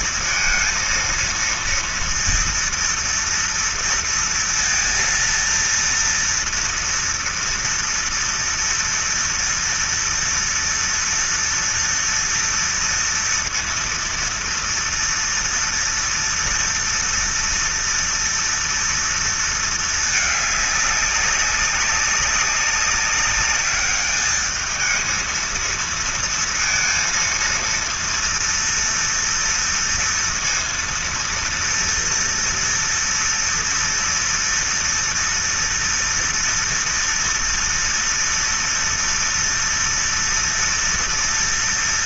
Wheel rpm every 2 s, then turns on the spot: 230, 230, 230, 230, 230, 230, 230, 230, 230, 230, 200, 200, 220, 230, 230, 230, 230, 230, 230, 230, 230.
none